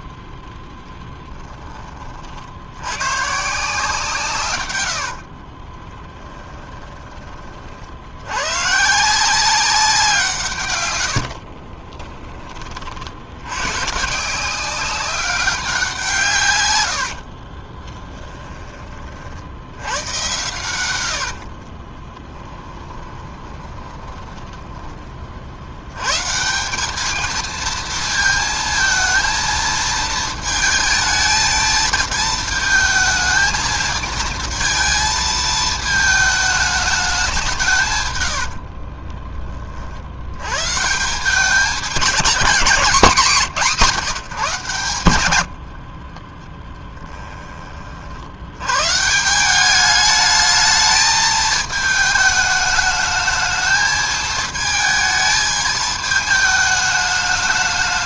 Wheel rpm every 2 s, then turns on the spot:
0, 100, 90, 20, 140, 120, 50, 190, 100, 30, 100, 20, 20, 200, 230, 220, 220, 220, 210, 50, 150, 190, 130, 10, 120, 220, 220, 220, 210.
4-8 20-24 38-40 42-44